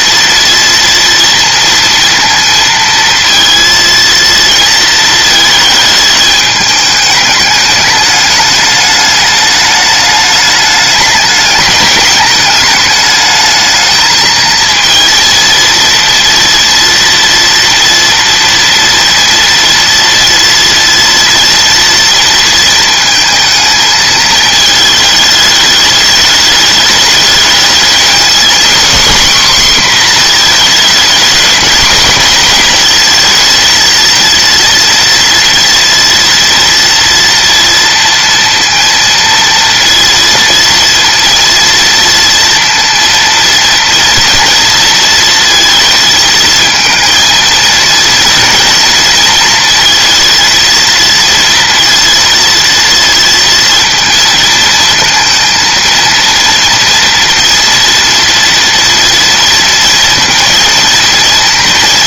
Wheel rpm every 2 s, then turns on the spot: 230, 230, 230, 210, 210, 210, 210, 230, 240, 230, 230, 230, 220, 210, 250, 230, 230, 230, 230, 230, 230, 230, 220, 220, 230, 230, 230, 230, 230, 230, 230.
none